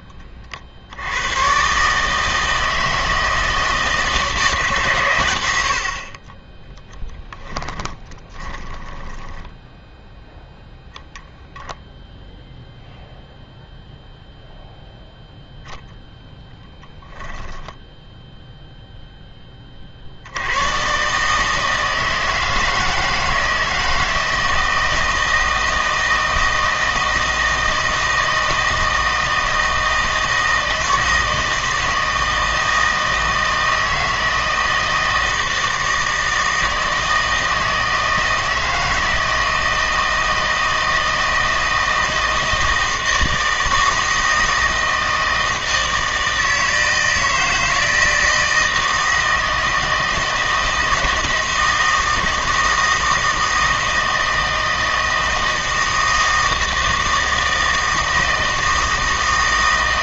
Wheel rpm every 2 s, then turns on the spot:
60, 160, 150, 10, 10, 0, 0, 0, 10, 0, 120, 160, 160, 160, 160, 160, 160, 160, 160, 160, 160, 160, 160, 160, 160, 160, 160, 160, 160, 160.
6-10 16-18